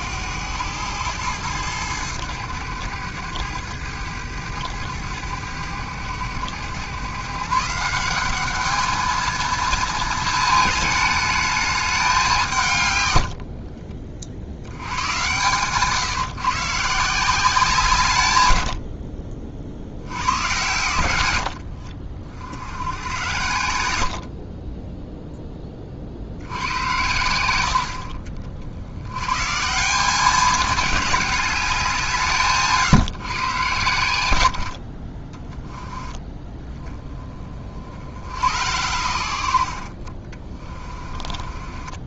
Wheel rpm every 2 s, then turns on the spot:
110, 100, 100, 120, 210, 220, 140, 80, 150, 70, 110, 70, 10, 90, 70, 200, 150, 60, 20, 90, 30.
24-26 40-42